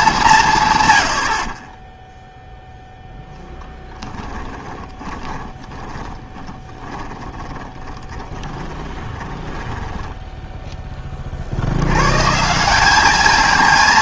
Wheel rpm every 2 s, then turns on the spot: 140, 0, 20, 10, 20, 10, 180.
4-10